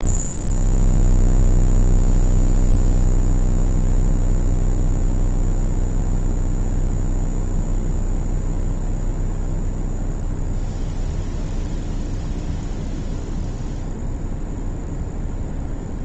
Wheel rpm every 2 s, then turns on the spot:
0, 0, 0, 0, 0, 0, 0, 0.
none